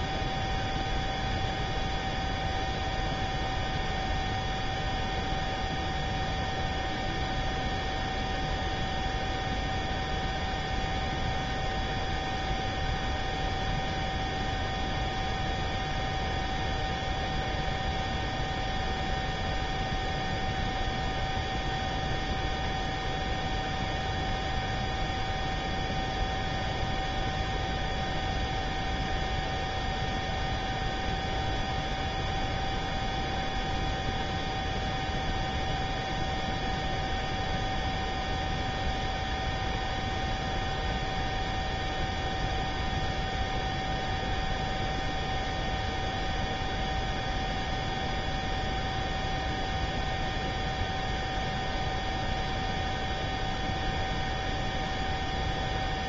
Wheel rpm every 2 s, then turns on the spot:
0, 0, 0, 0, 0, 0, 0, 0, 0, 0, 0, 0, 0, 0, 0, 0, 0, 0, 0, 0, 0, 0, 0, 0, 0, 0, 0, 0.
none